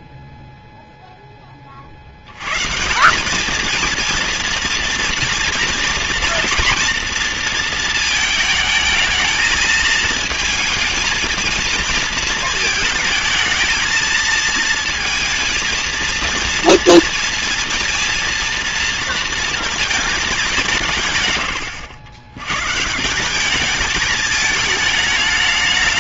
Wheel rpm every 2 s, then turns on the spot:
10, 190, 230, 230, 220, 220, 220, 230, 240, 230, 120, 190, 210.
none